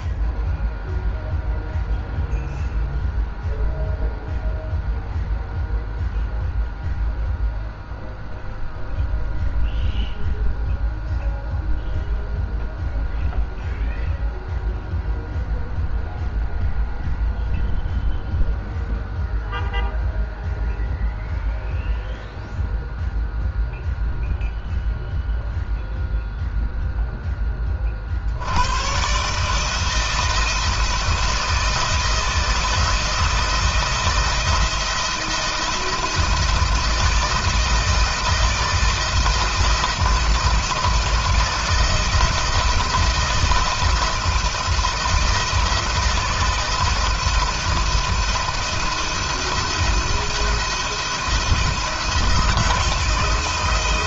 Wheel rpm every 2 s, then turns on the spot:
0, 0, 0, 0, 0, 0, 0, 0, 0, 0, 0, 0, 0, 0, 120, 160, 170, 170, 170, 160, 170, 170, 160, 160, 170, 170, 170.
none